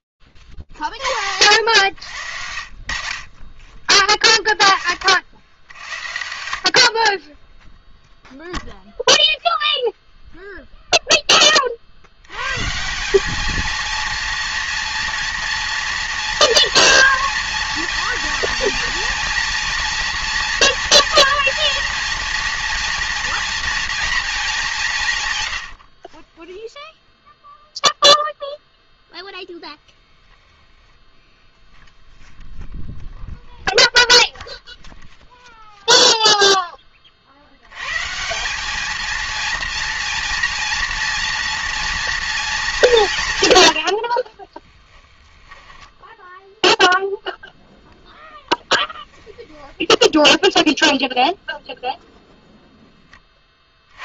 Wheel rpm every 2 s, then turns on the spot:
50, 60, 30, 0, 0, 170, 230, 240, 230, 240, 230, 170, 0, 0, 10, 0, 10, 0, 160, 230, 230, 50, 0, 0, 10, 0, 70.
42-44 48-50